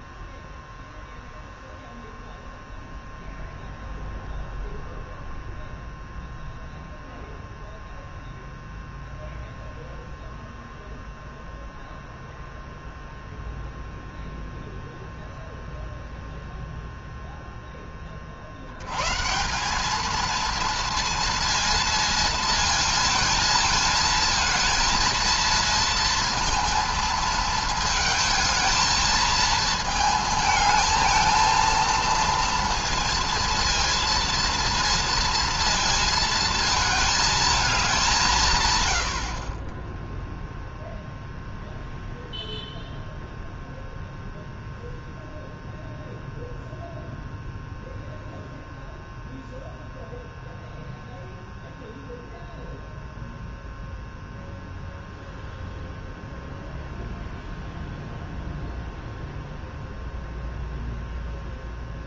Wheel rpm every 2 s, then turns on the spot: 0, 0, 0, 0, 0, 0, 0, 0, 0, 110, 230, 230, 230, 230, 230, 220, 230, 230, 220, 100, 0, 0, 0, 0, 0, 0, 0, 0, 0, 0, 0.
none